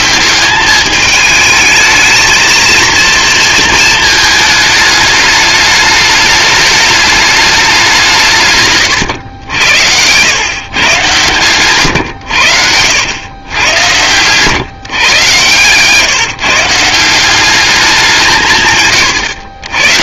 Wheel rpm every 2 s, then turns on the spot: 210, 220, 220, 210, 130, 120, 90, 130, 160, 150.
none